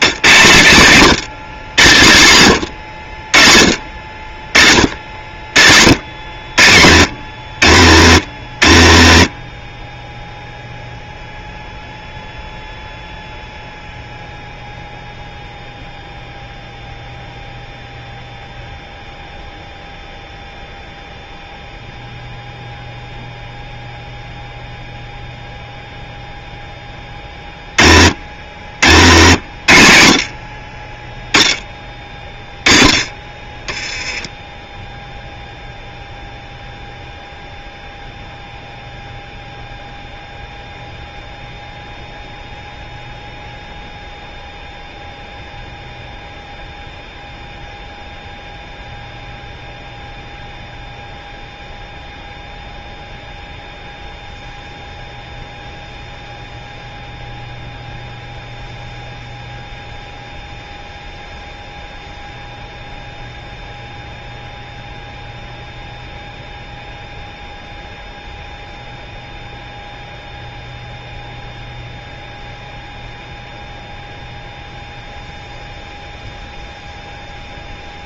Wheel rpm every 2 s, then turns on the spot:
130, 110, 60, 70, 50, 0, 0, 0, 0, 0, 0, 0, 0, 10, 80, 30, 20, 0, 0, 0, 0, 0, 0, 0, 0, 0, 0, 0, 0, 0, 0, 0, 0, 0, 0, 0, 0, 0, 0.
none